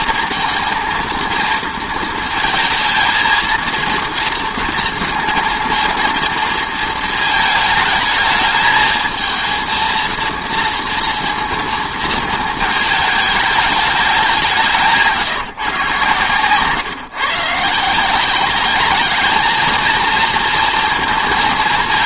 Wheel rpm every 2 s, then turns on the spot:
230, 220, 230, 220, 220, 230, 220, 170, 140, 200, 230.
none